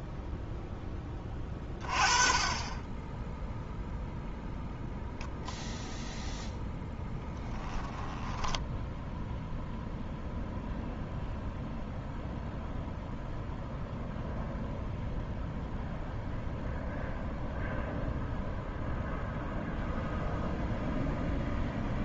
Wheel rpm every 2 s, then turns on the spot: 10, 10, 0, 10, 0, 0, 0, 0, 0, 0, 0.
none